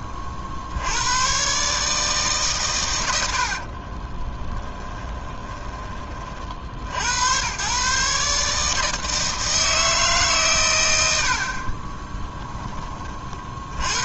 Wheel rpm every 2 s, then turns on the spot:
50, 140, 20, 60, 150, 140, 10.
4-6